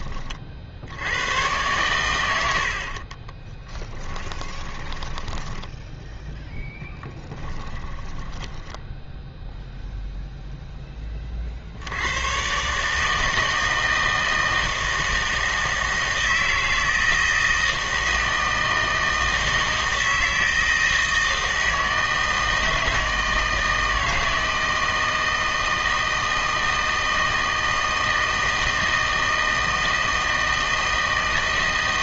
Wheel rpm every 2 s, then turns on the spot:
50, 80, 20, 10, 10, 0, 130, 160, 160, 160, 160, 160, 160, 160, 160, 160.
4-6 8-10